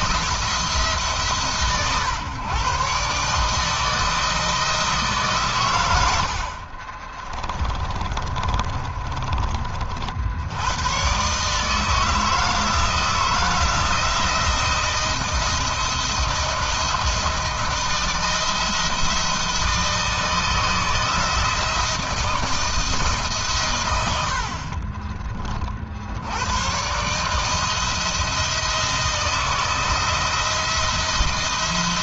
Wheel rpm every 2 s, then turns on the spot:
140, 140, 140, 30, 30, 110, 160, 170, 160, 160, 160, 160, 30, 140, 170, 170.
6-8 24-26